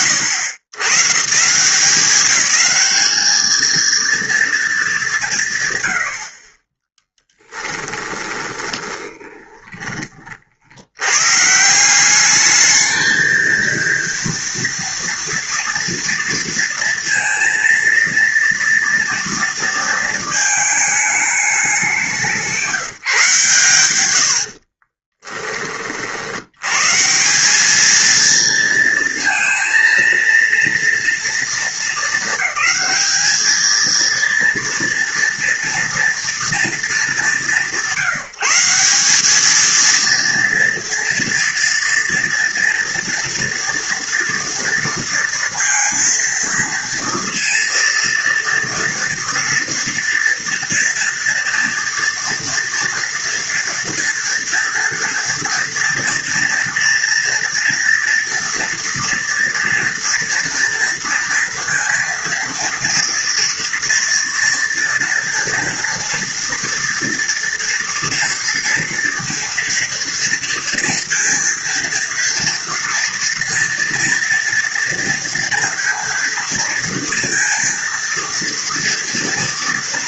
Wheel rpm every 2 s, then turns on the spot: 120, 210, 230, 20, 20, 90, 220, 240, 230, 230, 220, 160, 30, 140, 230, 230, 210, 230, 210, 190, 230, 230, 230, 230, 230, 240, 230, 230, 230, 230, 230, 230, 230, 230, 230, 230, 230, 230, 230, 230.
8-10 24-26